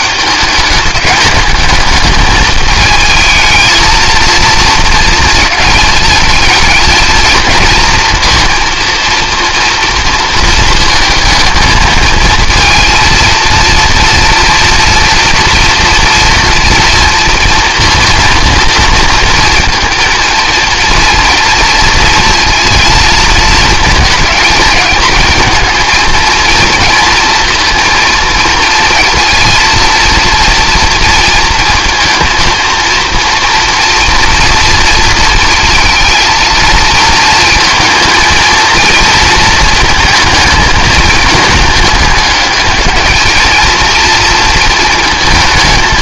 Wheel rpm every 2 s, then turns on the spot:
210, 210, 230, 220, 230, 230, 230, 230, 230, 230, 230, 230, 220, 230, 230, 230, 230, 230, 230, 230, 220, 210, 230.
none